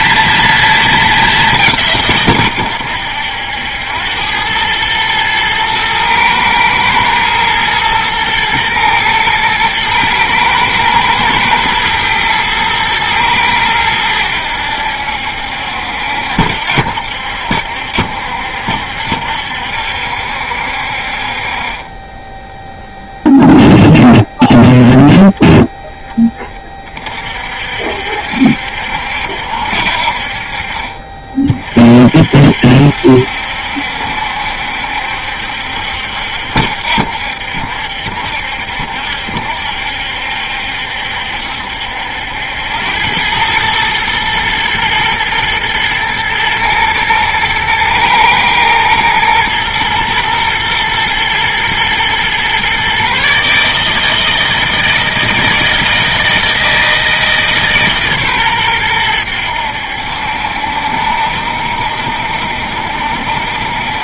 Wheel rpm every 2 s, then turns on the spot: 220, 110, 110, 110, 120, 110, 110, 80, 70, 70, 60, 0, 0, 30, 70, 40, 60, 70, 70, 70, 70, 90, 110, 110, 110, 110, 130, 160, 160, 110, 70, 70.
none